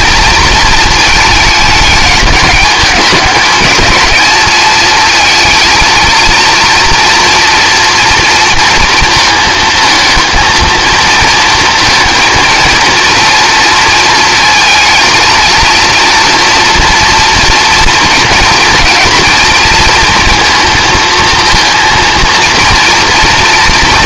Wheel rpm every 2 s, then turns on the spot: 220, 210, 220, 230, 230, 220, 230, 220, 230, 230, 220, 230.
none